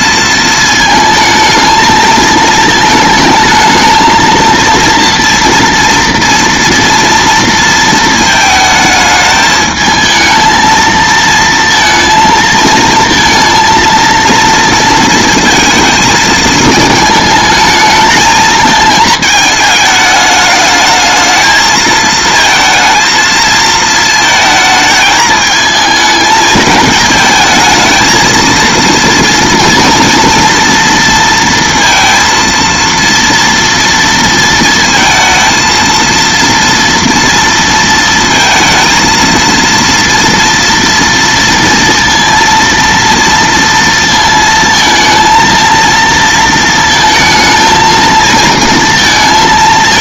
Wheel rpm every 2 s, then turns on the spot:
220, 220, 230, 230, 220, 220, 230, 230, 220, 220, 220, 220, 220, 220, 230, 230, 230, 230, 230, 230, 230, 230, 230, 230, 230.
none